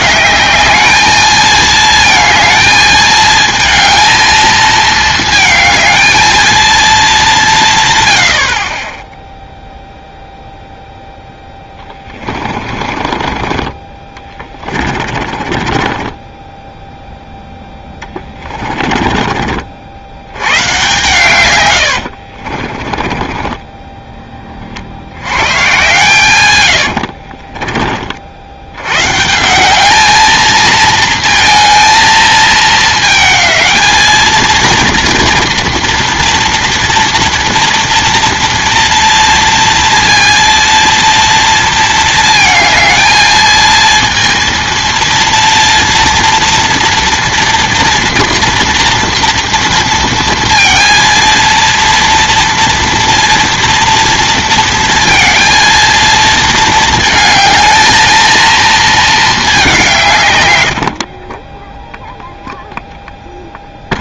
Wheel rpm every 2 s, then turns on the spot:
210, 220, 220, 220, 30, 0, 30, 30, 10, 20, 130, 30, 50, 100, 100, 230, 220, 230, 230, 230, 230, 220, 230, 230, 230, 230, 240, 230, 220, 230, 90, 0.
12-16 18-20 22-24 26-28